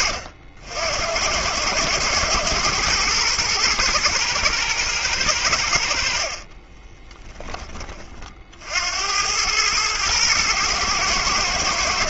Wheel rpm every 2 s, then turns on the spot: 80, 110, 110, 40, 60, 110.
6-8